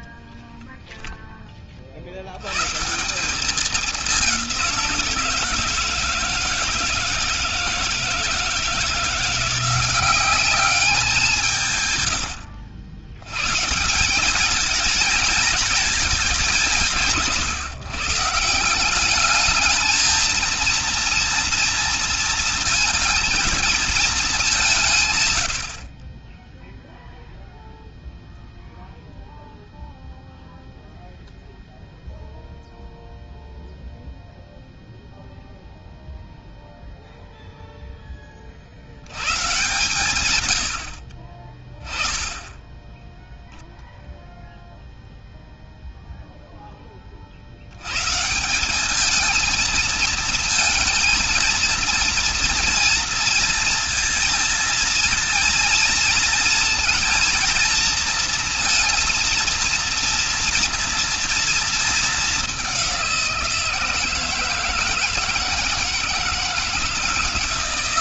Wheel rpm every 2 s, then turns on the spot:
0, 160, 180, 160, 170, 190, 110, 220, 180, 200, 230, 230, 150, 0, 0, 0, 0, 0, 0, 90, 70, 10, 0, 20, 210, 220, 230, 230, 230, 230, 230, 190, 160, 170.
none